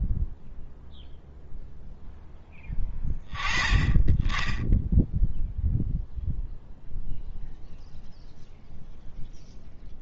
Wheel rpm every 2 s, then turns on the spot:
10, 10, 10, 0, 0.
none